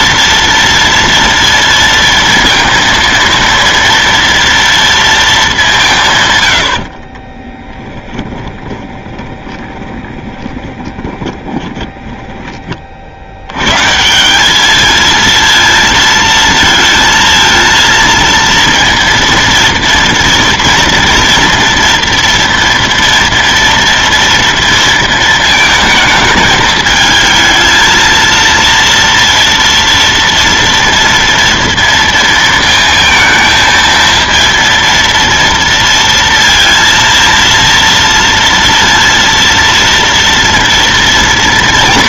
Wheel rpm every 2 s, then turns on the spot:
230, 230, 230, 90, 20, 20, 30, 200, 230, 230, 230, 230, 230, 220, 230, 230, 230, 230, 230, 230, 230.
8-12